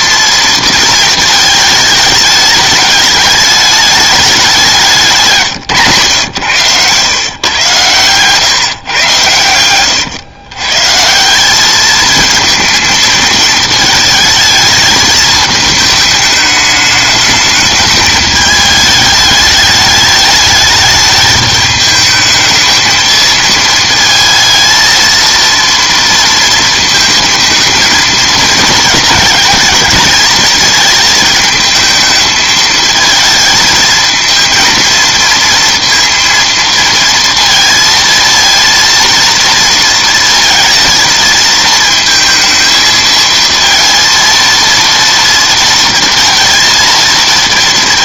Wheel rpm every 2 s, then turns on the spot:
230, 210, 190, 120, 140, 130, 220, 220, 210, 210, 210, 220, 230, 220, 220, 220, 220, 230, 230, 230, 230, 220, 230, 230.
6-8